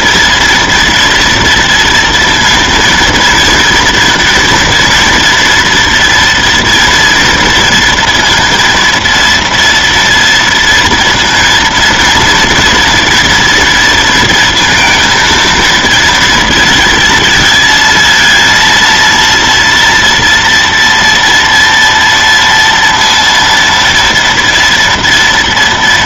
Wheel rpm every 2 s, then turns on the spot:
230, 230, 230, 240, 230, 230, 230, 230, 230, 230, 230, 230, 230.
none